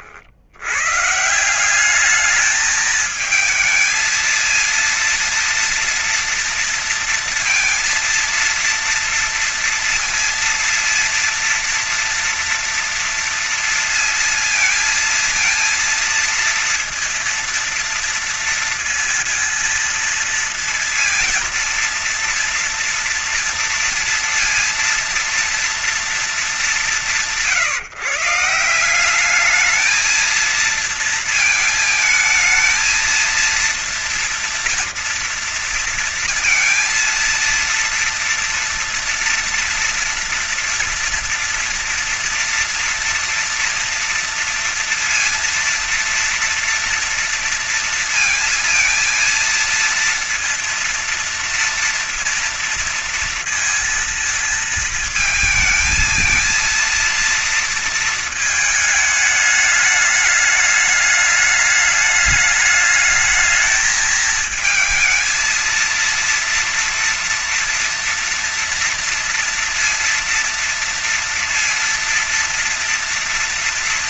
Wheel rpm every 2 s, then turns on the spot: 80, 210, 220, 230, 230, 230, 230, 230, 230, 230, 230, 230, 230, 190, 160, 220, 220, 230, 230, 230, 230, 230, 230, 230, 230, 230, 230, 230, 230, 220, 210, 210, 220, 230, 230, 230, 230.
none